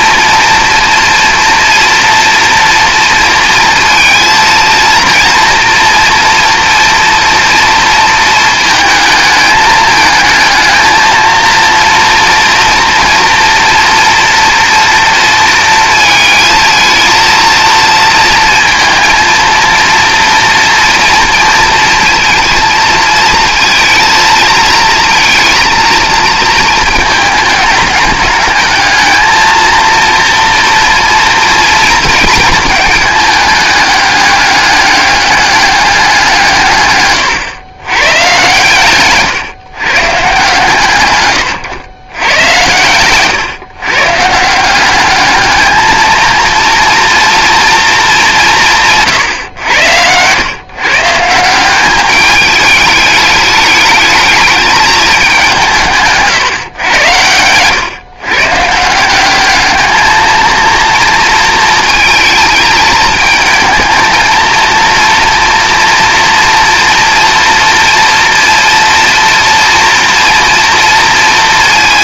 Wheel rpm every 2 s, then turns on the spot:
230, 230, 230, 230, 220, 230, 230, 230, 220, 230, 230, 230, 220, 220, 220, 230, 220, 200, 140, 130, 140, 110, 180, 230, 160, 130, 210, 210, 130, 160, 230, 220, 230, 230, 230, 230.
none